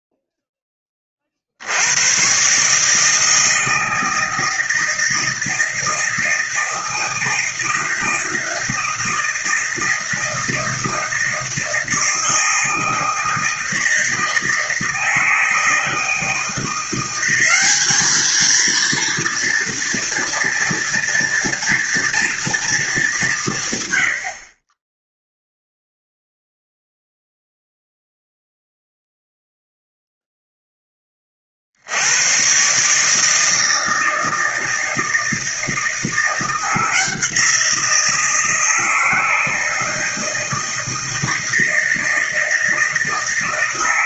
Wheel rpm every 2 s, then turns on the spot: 10, 140, 160, 160, 160, 160, 160, 160, 170, 230, 230, 230, 30, 0, 0, 10, 130, 160, 170, 160, 160, 160.
none